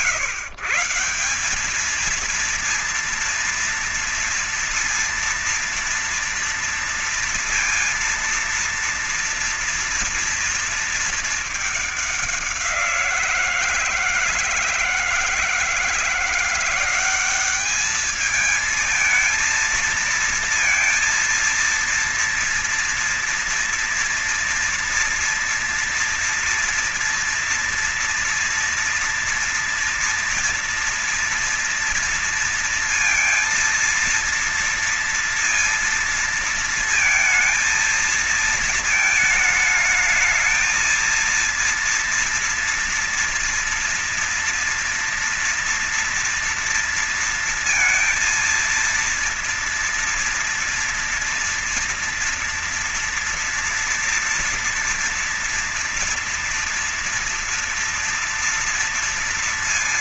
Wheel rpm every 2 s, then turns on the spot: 160, 230, 230, 230, 230, 230, 190, 160, 180, 220, 230, 230, 240, 240, 240, 230, 230, 230, 230, 230, 220, 230, 230, 230, 230, 230, 230, 230, 230, 230.
none